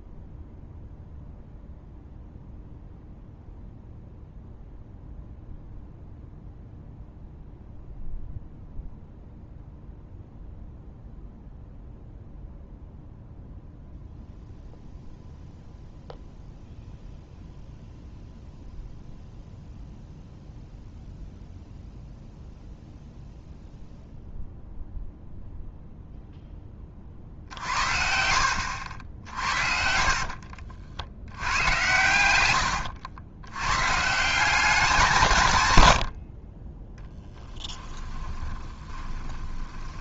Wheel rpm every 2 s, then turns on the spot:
0, 0, 0, 0, 0, 0, 0, 0, 0, 0, 0, 0, 0, 10, 60, 50, 100, 190, 30, 20.
30-34 38-40